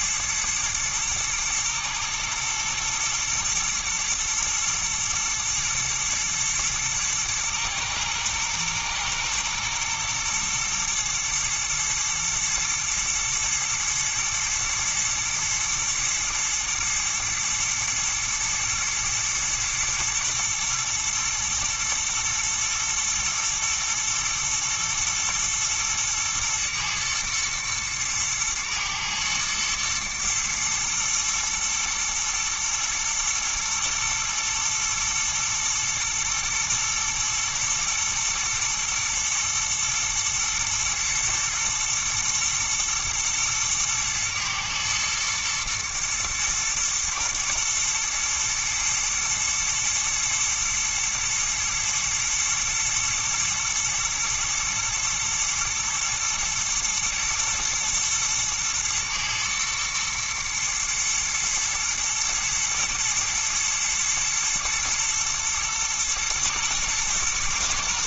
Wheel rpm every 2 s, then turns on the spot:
110, 120, 120, 120, 120, 120, 110, 110, 110, 110, 120, 120, 110, 110, 110, 110, 110, 110, 120, 120, 120, 120, 110, 110, 120, 120, 110, 110, 120, 110, 110, 120, 120, 120.
none